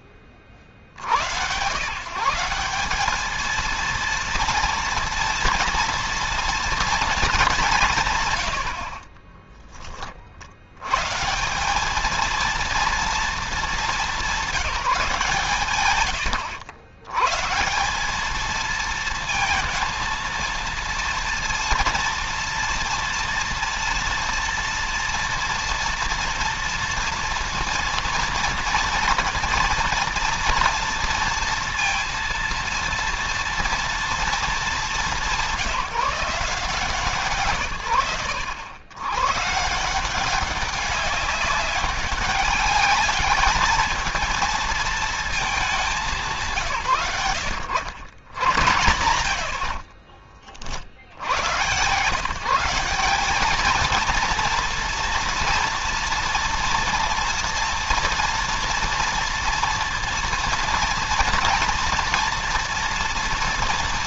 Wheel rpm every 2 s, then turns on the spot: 60, 200, 230, 220, 40, 130, 230, 180, 100, 220, 230, 230, 240, 230, 230, 230, 230, 200, 150, 120, 200, 200, 230, 110, 80, 70, 190, 230, 230, 230, 230, 230.
8-10 48-50